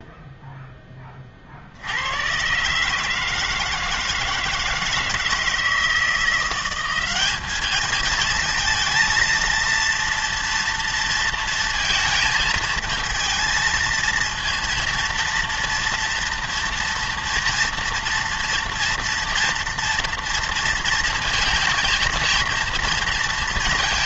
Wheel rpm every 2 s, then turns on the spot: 0, 130, 160, 180, 220, 230, 220, 230, 230, 230, 230, 230.
none